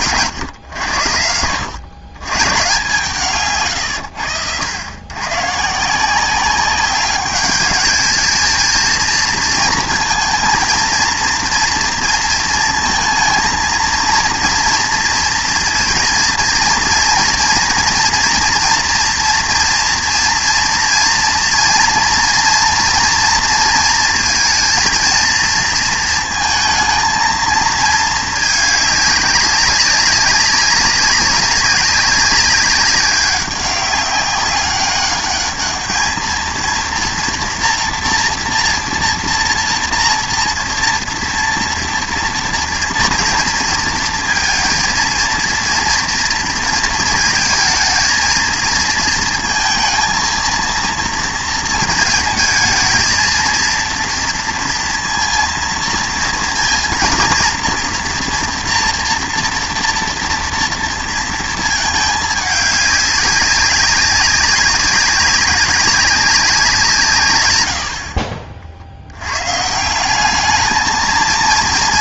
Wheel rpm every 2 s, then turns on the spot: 110, 140, 100, 190, 230, 230, 220, 230, 240, 240, 230, 230, 230, 220, 210, 200, 190, 200, 230, 230, 230, 240, 230, 230, 220, 230, 220, 230, 230, 230, 230, 210, 200, 170, 50, 210.
none